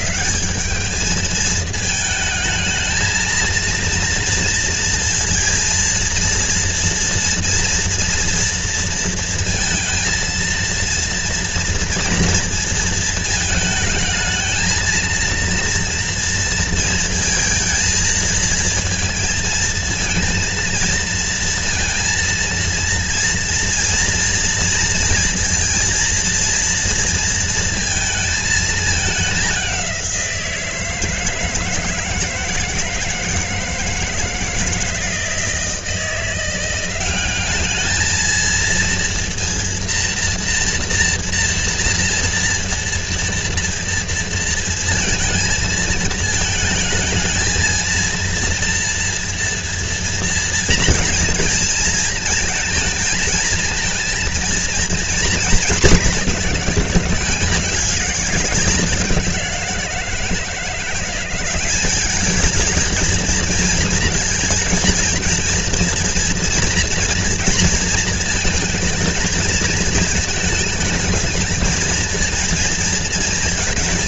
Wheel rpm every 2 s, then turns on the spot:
210, 220, 230, 240, 230, 230, 230, 220, 230, 230, 230, 230, 230, 230, 210, 160, 150, 160, 180, 230, 230, 230, 230, 220, 230, 230, 220, 230, 190, 190, 180, 220, 230, 230, 220, 220, 230.
none